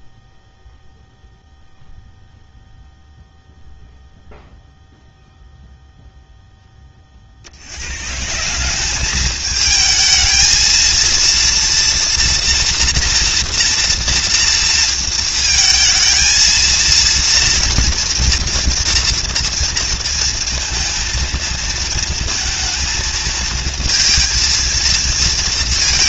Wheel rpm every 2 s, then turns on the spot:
0, 0, 0, 80, 220, 230, 230, 230, 230, 230, 220, 220, 230.
none